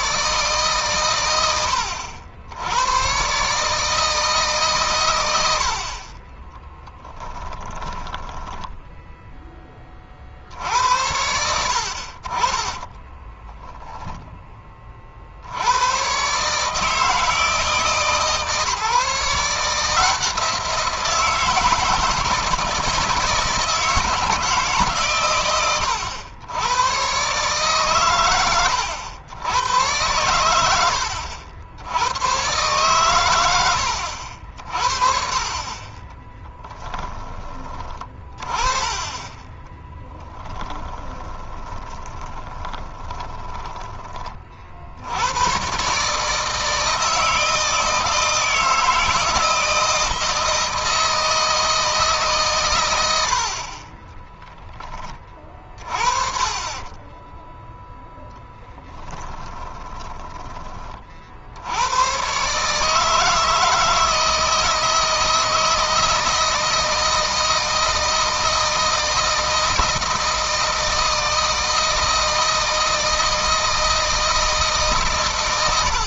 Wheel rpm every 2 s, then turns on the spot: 130, 110, 120, 10, 10, 70, 20, 30, 150, 150, 170, 160, 140, 110, 100, 80, 110, 50, 10, 20, 10, 20, 60, 160, 160, 160, 120, 10, 30, 10, 30, 140, 160, 160, 160, 160, 160, 150.
6-8 12-14 40-44 58-60